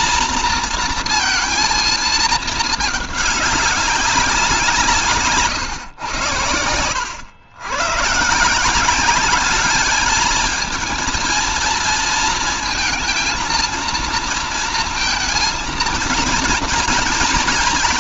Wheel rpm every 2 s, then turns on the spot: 230, 210, 170, 90, 170, 220, 230, 230, 230.
none